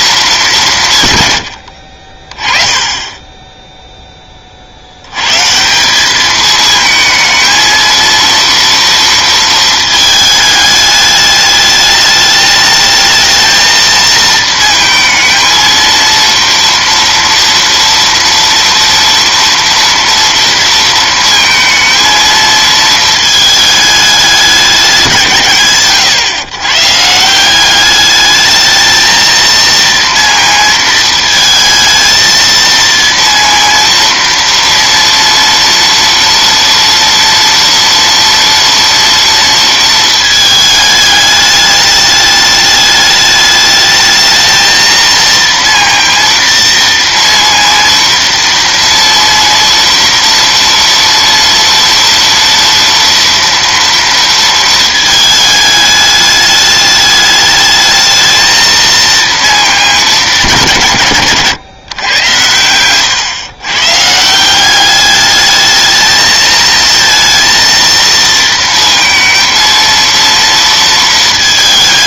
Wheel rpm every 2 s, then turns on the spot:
190, 20, 40, 220, 230, 210, 210, 230, 230, 230, 230, 230, 200, 130, 210, 230, 230, 230, 230, 230, 220, 210, 220, 230, 230, 230, 230, 230, 210, 220, 190, 110, 180, 220, 230, 230.
none